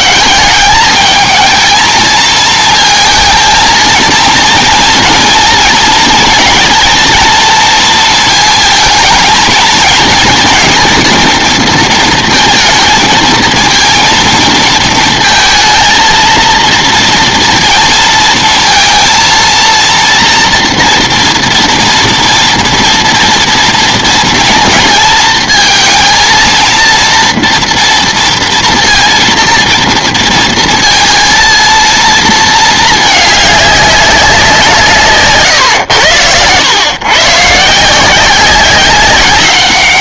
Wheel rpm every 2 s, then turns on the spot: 200, 220, 230, 230, 220, 230, 230, 230, 230, 230, 230, 230, 230, 230, 230, 230, 220, 170, 110, 190.
none